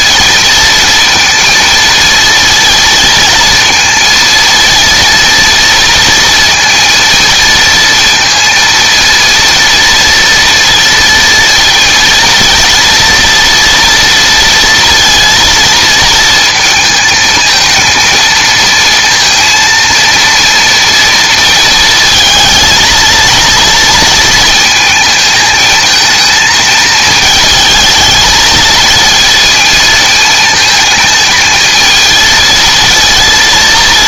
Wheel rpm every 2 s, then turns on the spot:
230, 230, 230, 230, 230, 230, 230, 230, 230, 230, 230, 220, 220, 220, 220, 220, 230.
none